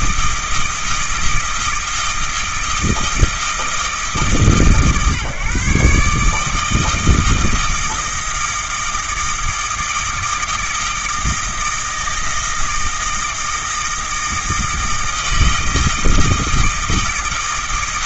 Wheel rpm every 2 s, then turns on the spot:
160, 160, 150, 160, 160, 160, 160, 160, 160.
none